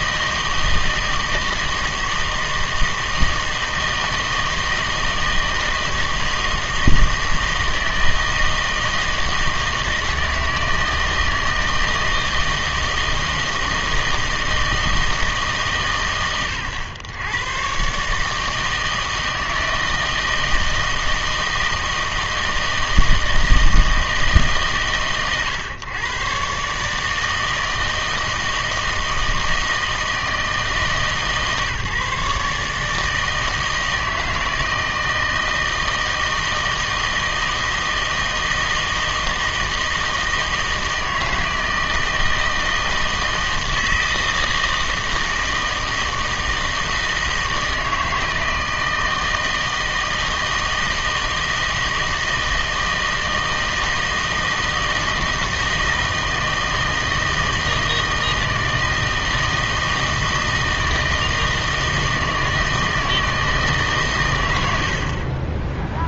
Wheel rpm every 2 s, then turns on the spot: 160, 160, 160, 160, 160, 160, 160, 160, 110, 160, 160, 160, 140, 140, 160, 160, 150, 160, 160, 160, 160, 160, 160, 160, 160, 160, 160, 160, 160, 160, 160, 160, 80.
none